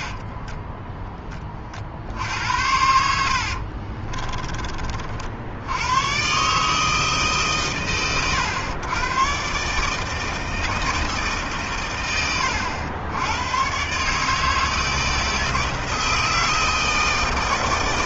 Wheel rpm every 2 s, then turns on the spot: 20, 70, 60, 130, 130, 150, 110, 160, 160.
2-4